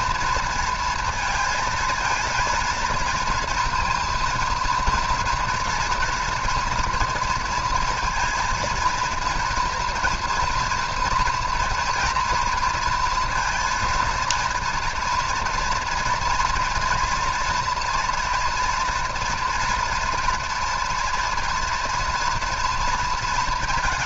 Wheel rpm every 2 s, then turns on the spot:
230, 230, 230, 230, 230, 240, 230, 230, 230, 230, 230, 230.
none